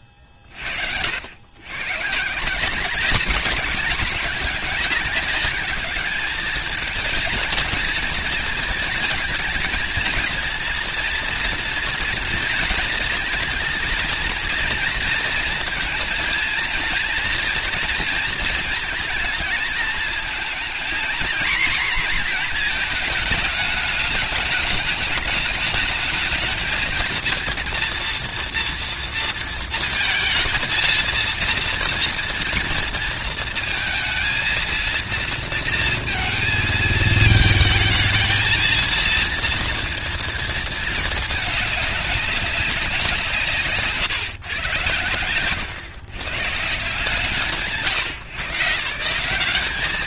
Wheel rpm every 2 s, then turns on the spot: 60, 170, 200, 220, 220, 230, 230, 230, 230, 220, 230, 230, 210, 220, 230, 230, 230, 230, 220, 230, 220, 190, 110, 140, 150.
none